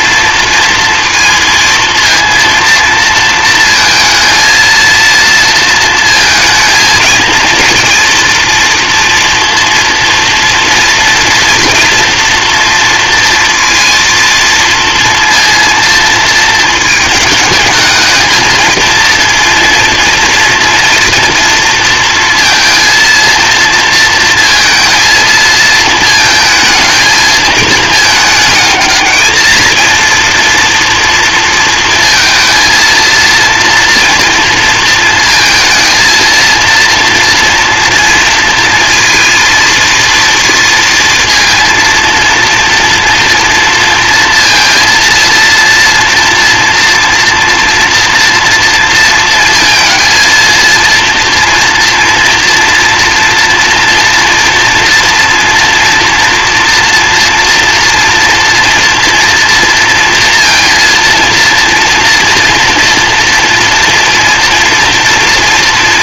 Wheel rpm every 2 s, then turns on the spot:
230, 230, 230, 230, 230, 240, 230, 230, 210, 230, 230, 230, 220, 220, 220, 230, 230, 230, 230, 230, 230, 230, 230, 230, 230, 230, 240, 230, 230, 230, 230, 240, 230.
none